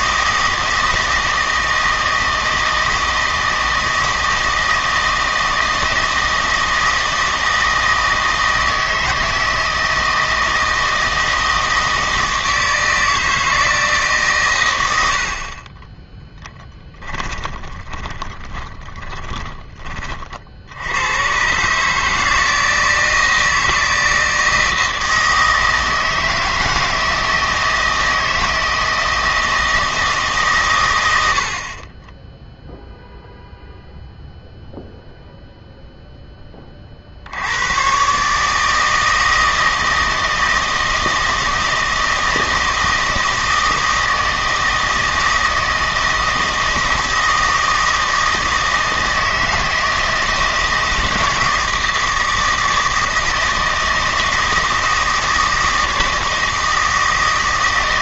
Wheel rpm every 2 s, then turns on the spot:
160, 160, 160, 160, 160, 160, 160, 100, 10, 20, 80, 160, 160, 160, 160, 120, 0, 0, 30, 160, 160, 160, 160, 160, 160, 160, 160, 160, 160.
16-20